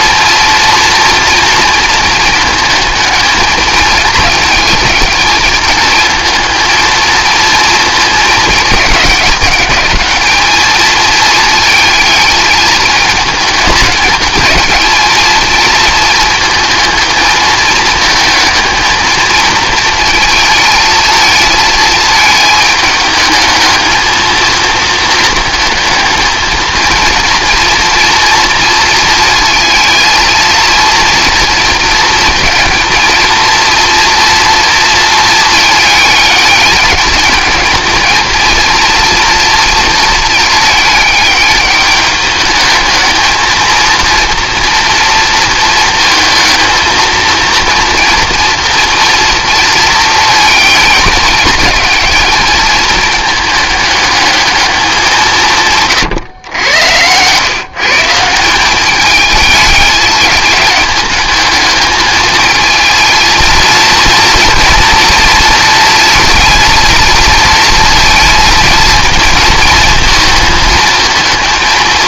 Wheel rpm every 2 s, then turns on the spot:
230, 220, 220, 220, 220, 210, 220, 220, 230, 220, 230, 220, 220, 220, 230, 230, 230, 230, 210, 220, 220, 210, 230, 230, 230, 230, 220, 210, 120, 170, 210, 220, 240, 230, 230, 220.
none